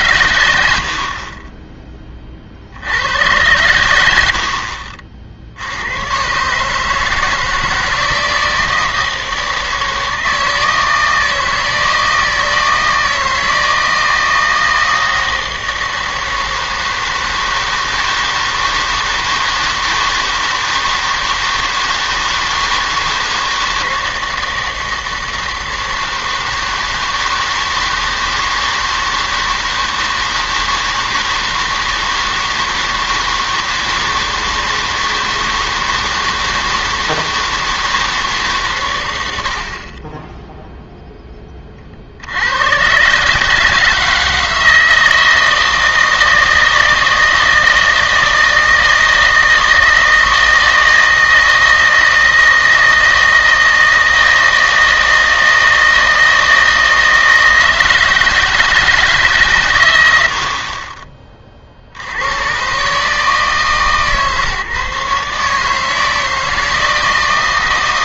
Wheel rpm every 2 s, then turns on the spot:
80, 70, 50, 150, 160, 160, 160, 160, 160, 160, 160, 160, 160, 160, 160, 160, 160, 160, 160, 130, 0, 110, 160, 160, 160, 160, 160, 160, 160, 160, 40, 100, 140, 160.
none